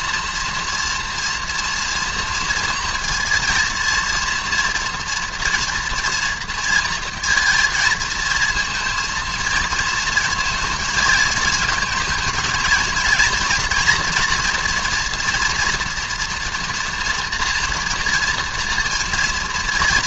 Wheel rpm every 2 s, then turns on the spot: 230, 230, 240, 230, 230, 220, 220, 240, 230, 230.
none